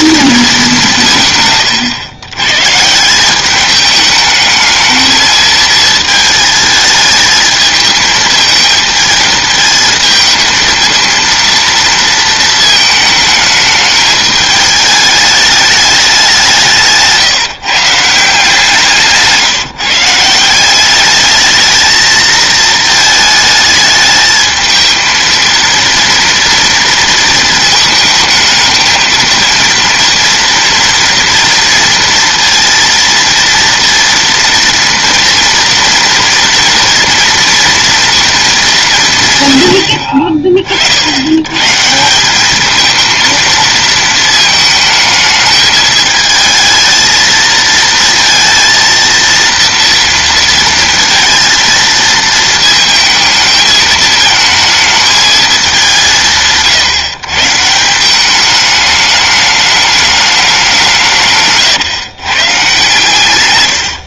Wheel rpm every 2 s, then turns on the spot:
200, 120, 220, 220, 220, 220, 230, 210, 170, 170, 180, 220, 220, 230, 220, 230, 230, 230, 230, 210, 50, 210, 220, 220, 230, 230, 230, 220, 150, 210, 190, 140.
none